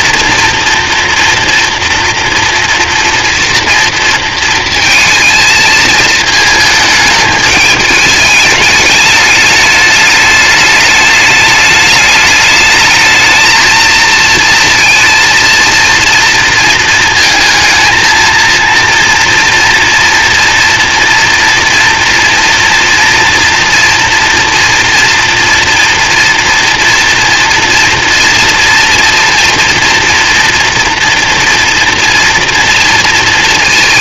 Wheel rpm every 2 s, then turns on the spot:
230, 230, 230, 220, 210, 210, 210, 230, 230, 230, 230, 230, 230, 230, 230, 230, 230.
none